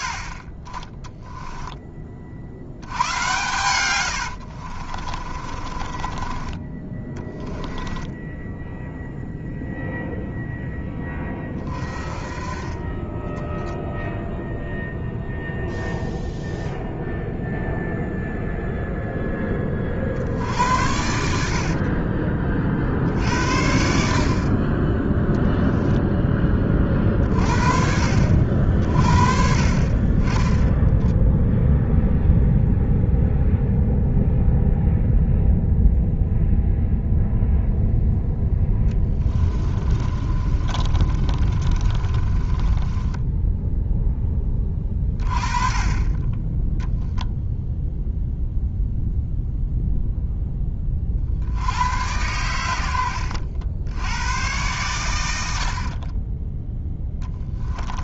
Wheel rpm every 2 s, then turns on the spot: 40, 90, 50, 20, 0, 10, 30, 0, 0, 0, 70, 50, 20, 30, 50, 10, 0, 0, 0, 10, 30, 20, 30, 0, 0, 40, 80, 100, 10.
4-6 38-44 52-54